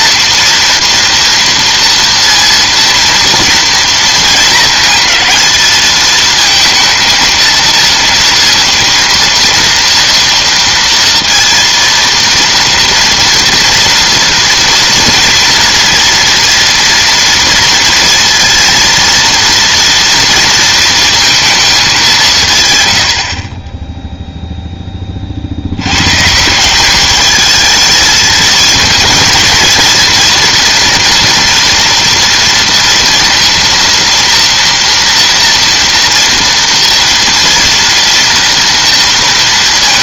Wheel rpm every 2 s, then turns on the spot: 230, 230, 230, 230, 230, 230, 230, 240, 230, 230, 230, 160, 0, 160, 220, 230, 230, 230, 230, 230.
none